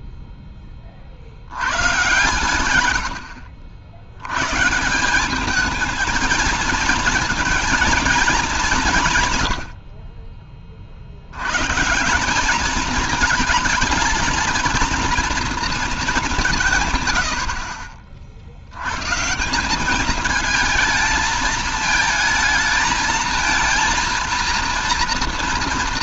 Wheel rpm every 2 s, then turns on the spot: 10, 120, 120, 230, 210, 30, 210, 220, 180, 70, 220, 220, 230.
none